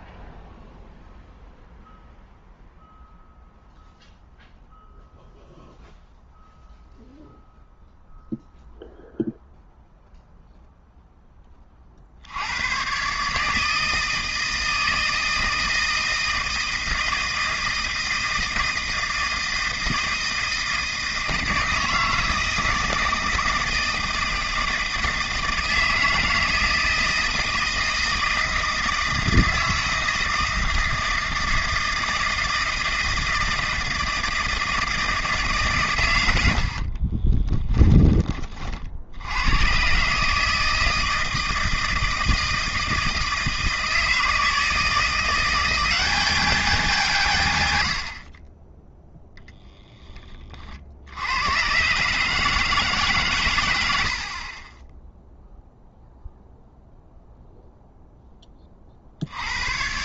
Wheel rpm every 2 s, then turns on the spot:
0, 0, 0, 0, 0, 0, 110, 160, 160, 160, 160, 160, 160, 160, 160, 160, 160, 160, 60, 50, 160, 160, 160, 200, 20, 50, 150, 20, 0, 30.
36-38